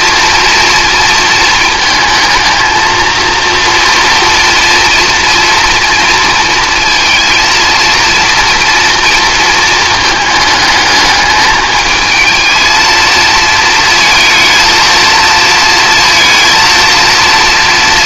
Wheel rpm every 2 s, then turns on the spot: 230, 230, 240, 230, 230, 210, 220, 230, 230.
none